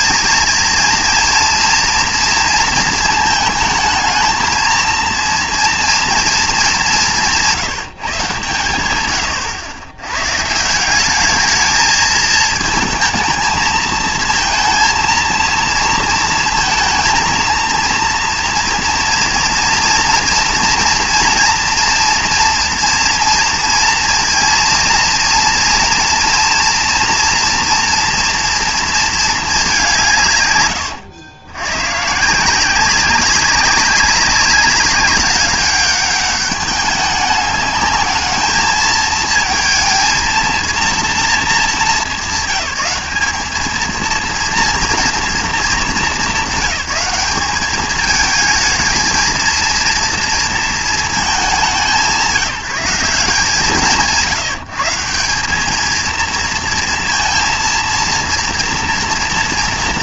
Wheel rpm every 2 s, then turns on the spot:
230, 230, 230, 210, 90, 180, 220, 230, 220, 230, 240, 230, 230, 230, 230, 120, 180, 190, 200, 220, 230, 200, 230, 200, 220, 230, 180, 170, 230, 230.
none